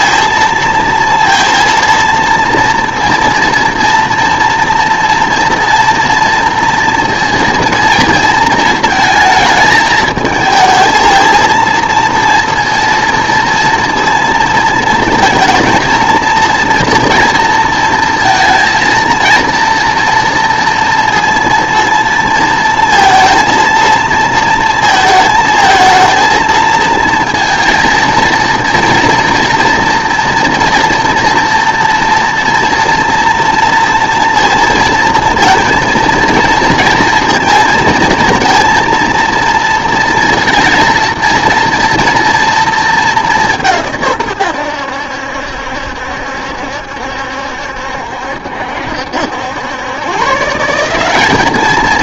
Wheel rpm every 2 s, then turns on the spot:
230, 230, 230, 230, 230, 220, 230, 230, 230, 230, 230, 230, 220, 230, 230, 230, 230, 230, 230, 230, 230, 230, 100, 70, 70, 170.
none